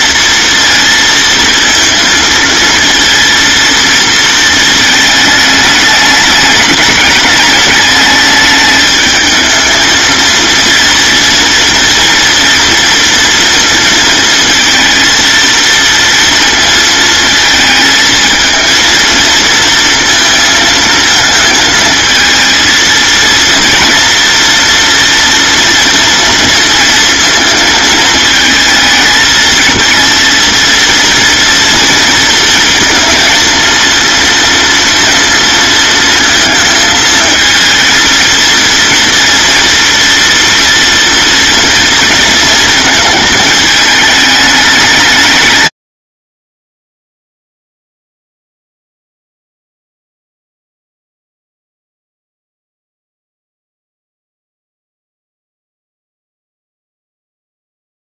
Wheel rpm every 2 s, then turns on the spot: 230, 230, 220, 210, 210, 240, 230, 230, 220, 230, 220, 230, 240, 230, 220, 230, 230, 230, 220, 230, 240, 230, 180, 0, 0, 0, 0, 0, 0.
none